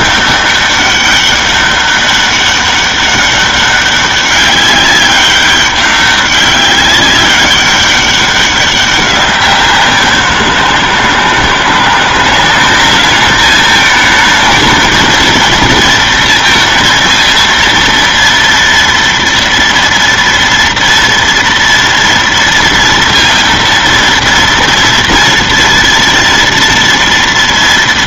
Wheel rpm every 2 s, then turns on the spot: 200, 200, 200, 200, 190, 170, 200, 220, 230, 230, 230, 230, 230, 230.
none